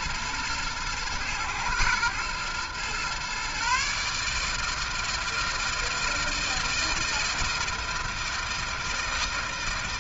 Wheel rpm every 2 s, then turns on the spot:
110, 120, 150, 160, 160.
none